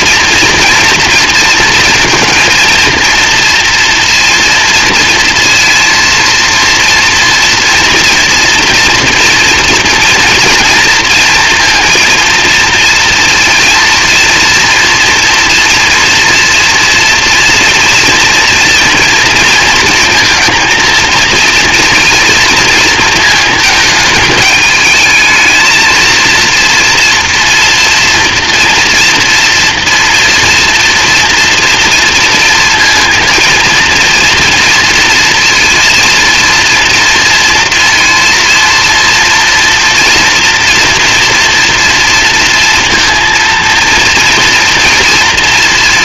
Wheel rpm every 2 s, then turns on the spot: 230, 230, 230, 230, 230, 230, 230, 230, 230, 230, 230, 230, 210, 230, 230, 240, 230, 230, 230, 230, 240, 230, 230.
none